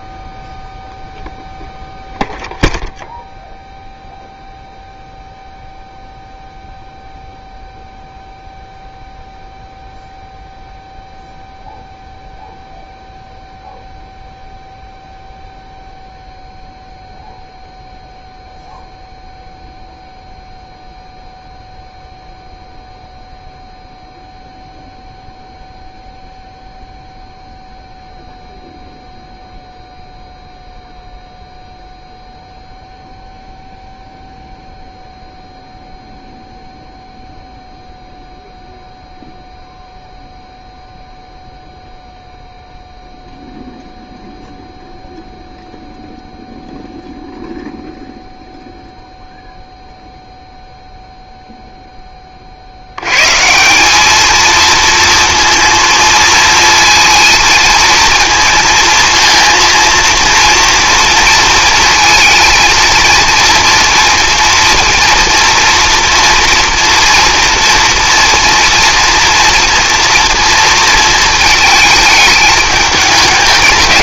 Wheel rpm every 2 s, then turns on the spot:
0, 0, 0, 0, 0, 0, 0, 0, 0, 0, 0, 0, 0, 0, 0, 0, 0, 0, 0, 0, 0, 0, 0, 0, 0, 0, 70, 220, 230, 230, 230, 230, 230, 230, 240, 230, 210.
none